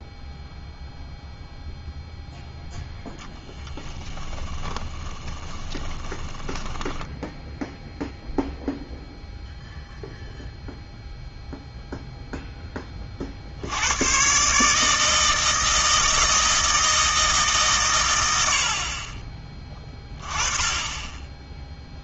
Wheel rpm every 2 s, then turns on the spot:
0, 0, 20, 10, 0, 0, 10, 150, 160, 80, 20.
4-8